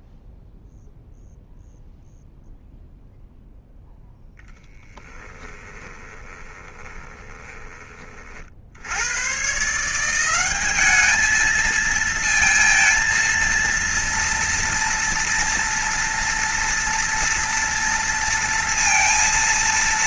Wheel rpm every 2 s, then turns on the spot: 0, 0, 10, 20, 80, 210, 230, 240, 230, 230.
4-8